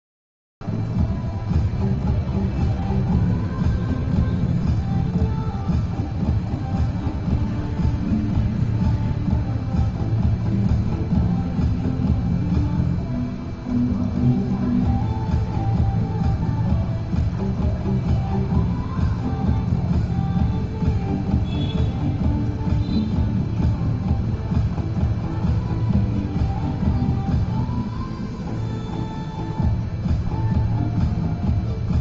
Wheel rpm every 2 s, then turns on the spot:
0, 0, 0, 0, 0, 0, 0, 0, 0, 0, 0, 0, 0, 0, 0, 0.
none